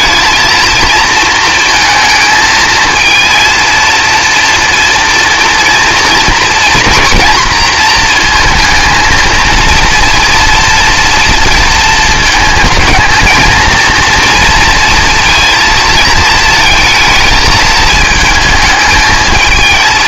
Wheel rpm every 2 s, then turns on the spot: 230, 220, 230, 220, 230, 230, 220, 230, 220, 220.
none